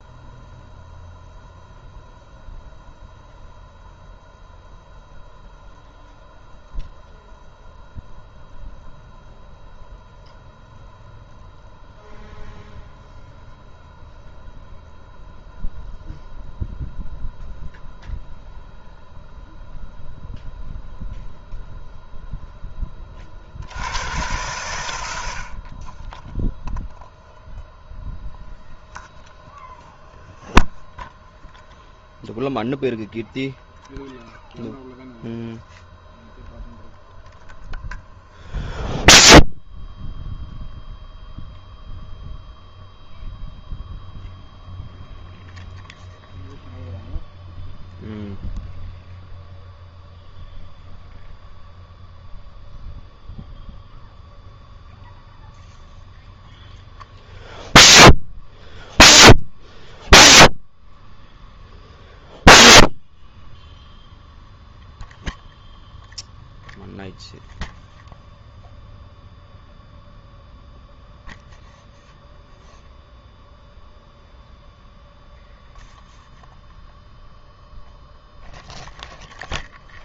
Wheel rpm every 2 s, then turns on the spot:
0, 0, 0, 0, 0, 0, 0, 0, 0, 0, 0, 0, 110, 0, 0, 0, 0, 0, 0, 0, 0, 0, 0, 0, 0, 0, 0, 0, 0, 0, 0, 0, 0, 0, 0, 0, 0, 0, 0, 0.
none